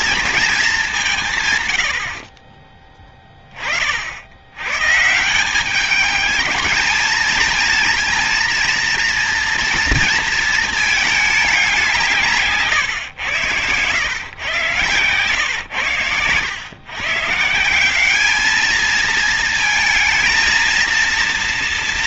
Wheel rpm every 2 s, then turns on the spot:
130, 20, 160, 220, 230, 210, 130, 120, 140, 220, 230.
none